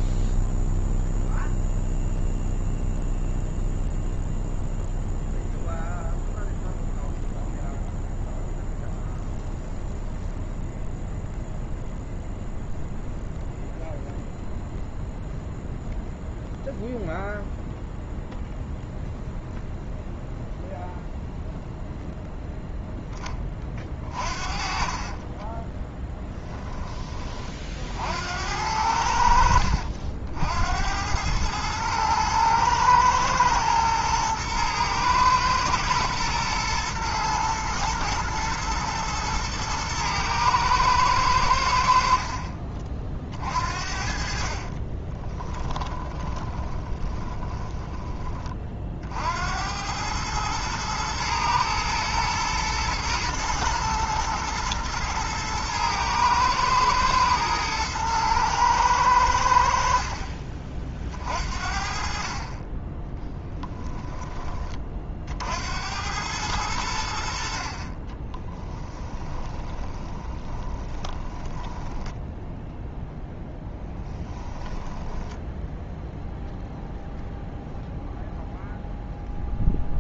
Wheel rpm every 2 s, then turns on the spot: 0, 0, 0, 0, 0, 0, 0, 0, 0, 0, 0, 0, 30, 30, 80, 90, 110, 110, 120, 120, 110, 40, 30, 20, 50, 110, 110, 110, 110, 110, 50, 10, 50, 80, 10, 20, 0, 10, 0, 0.
24-26 44-48 68-72 74-76